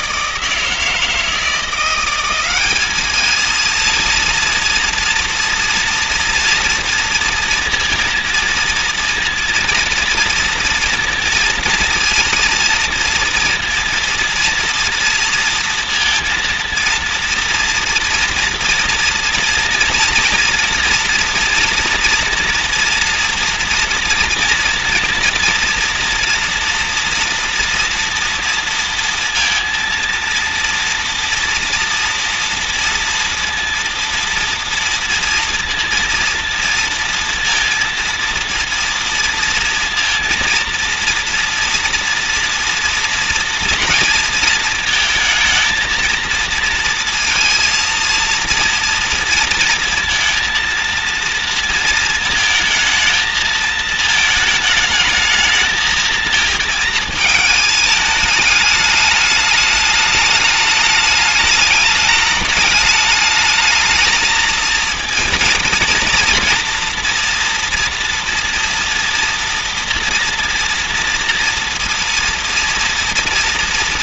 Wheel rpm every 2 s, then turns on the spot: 170, 190, 230, 230, 230, 230, 230, 240, 230, 230, 230, 240, 230, 240, 230, 230, 230, 230, 230, 230, 230, 230, 230, 230, 230, 230, 220, 220, 230, 210, 210, 210, 220, 230, 230, 230, 240.
none